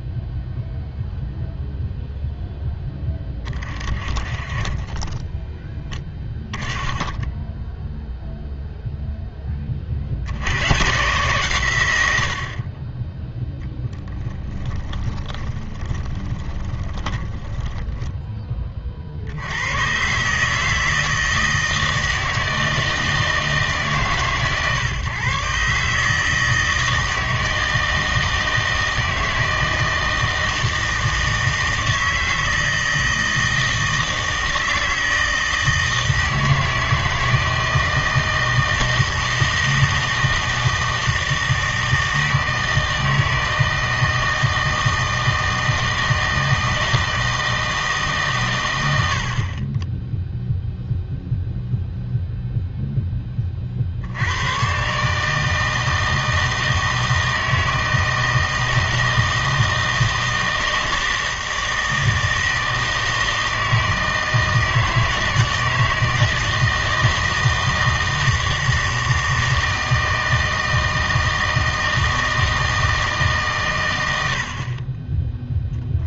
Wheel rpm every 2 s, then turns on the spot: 0, 0, 30, 10, 0, 100, 40, 10, 20, 40, 160, 160, 140, 160, 160, 160, 160, 160, 160, 160, 160, 160, 160, 160, 70, 0, 10, 140, 160, 160, 160, 160, 160, 160, 160, 160, 160, 20.
14-18